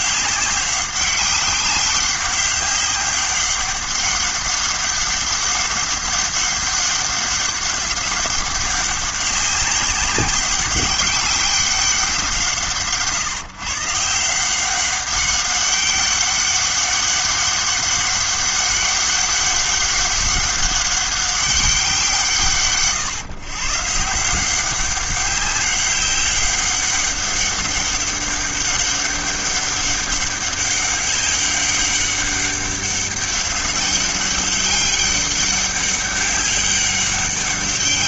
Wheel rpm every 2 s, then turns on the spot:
200, 200, 200, 200, 200, 200, 150, 190, 200, 200, 200, 140, 180, 200, 200, 200, 200, 200, 200.
none